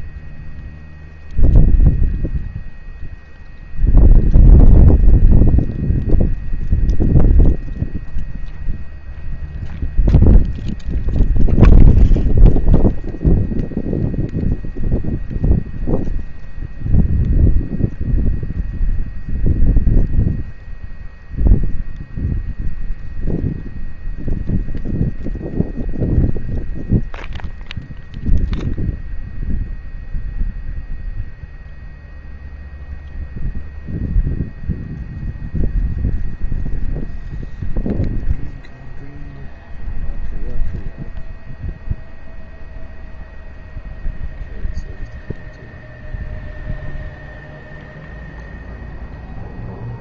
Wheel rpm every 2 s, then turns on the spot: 0, 0, 0, 0, 0, 0, 0, 0, 0, 0, 0, 0, 0, 0, 0, 0, 0, 0, 0, 0, 0, 0, 0, 0, 0.
none